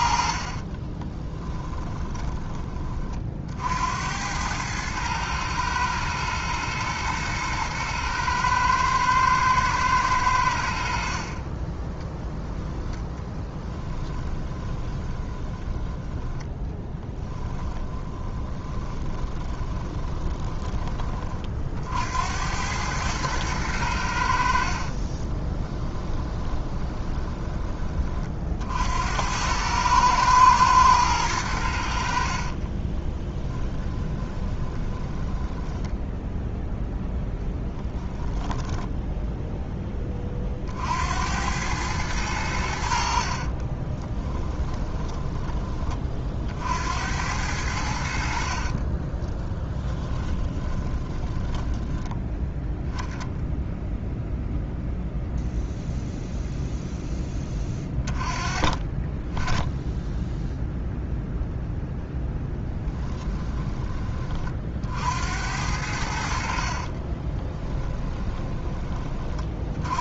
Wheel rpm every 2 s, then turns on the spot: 30, 30, 110, 110, 110, 70, 0, 20, 10, 20, 20, 100, 50, 20, 70, 110, 30, 10, 0, 10, 60, 80, 20, 70, 30, 20, 0, 0, 0, 30, 0, 10, 50, 50, 20.
0-2 14-20 24-28 32-36 38-40 44-46 48-52 62-64 66-68